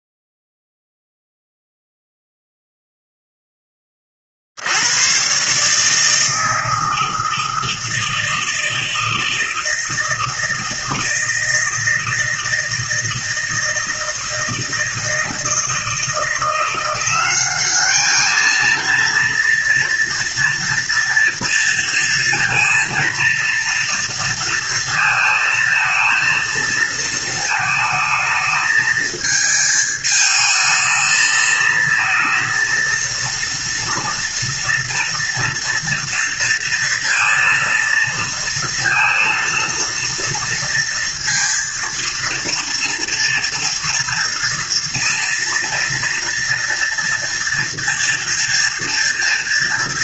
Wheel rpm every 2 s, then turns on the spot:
0, 0, 80, 160, 160, 160, 160, 160, 170, 230, 230, 230, 230, 220, 220, 220, 230, 230, 230, 230, 230, 230, 230, 240, 240.
none